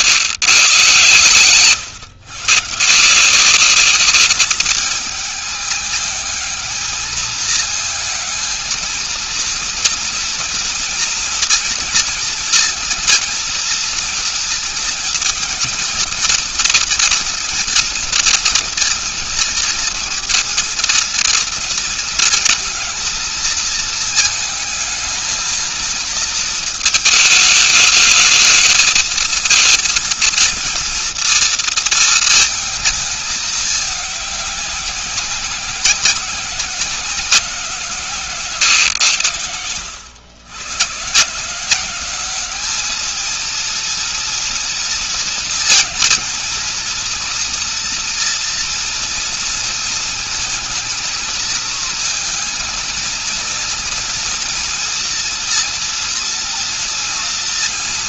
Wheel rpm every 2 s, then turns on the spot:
130, 130, 210, 210, 220, 230, 230, 230, 230, 230, 230, 230, 220, 220, 220, 230, 230, 200, 180, 140, 100, 200, 230, 230, 230, 230, 230, 240, 230.
none